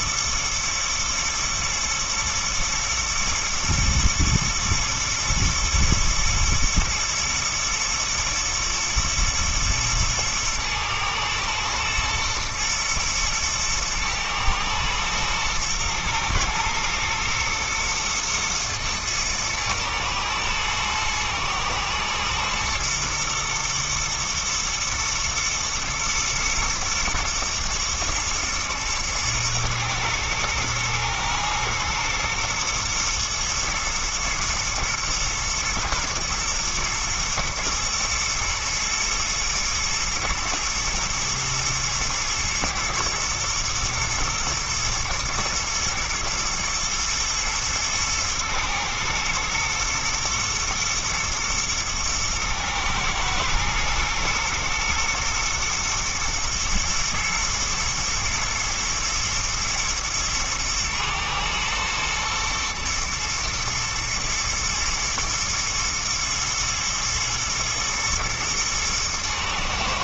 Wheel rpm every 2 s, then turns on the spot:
120, 110, 120, 110, 110, 110, 120, 110, 110, 110, 120, 120, 110, 110, 120, 120, 120, 120, 120, 110, 110, 110, 110, 110, 120, 110, 110, 120, 110, 120, 110, 110, 120, 120, 110.
none